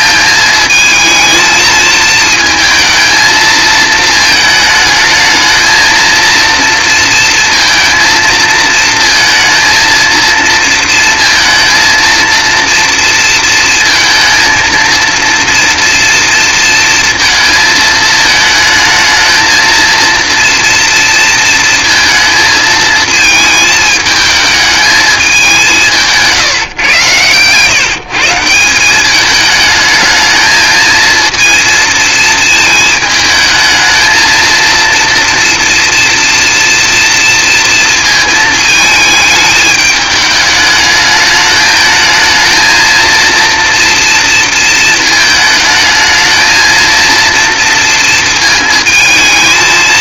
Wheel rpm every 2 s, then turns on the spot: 220, 230, 220, 230, 230, 230, 230, 230, 230, 220, 230, 220, 220, 150, 170, 220, 220, 230, 230, 220, 210, 220, 230, 220, 220.
none